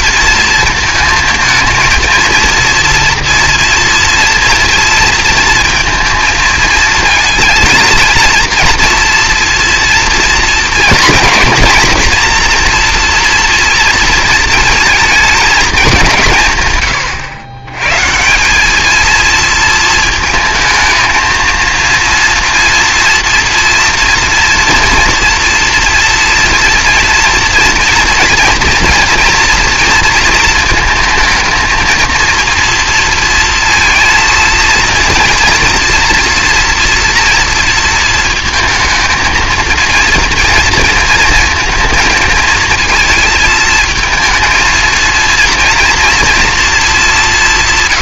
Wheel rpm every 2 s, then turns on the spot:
230, 230, 230, 230, 230, 230, 240, 230, 150, 200, 220, 230, 230, 240, 230, 230, 230, 230, 240, 220, 230, 220, 230, 230.
none